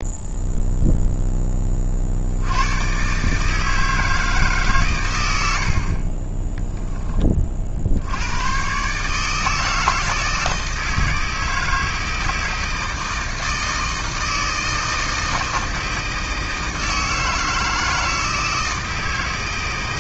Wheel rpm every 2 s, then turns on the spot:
0, 100, 140, 10, 120, 160, 160, 160, 160, 160.
6-8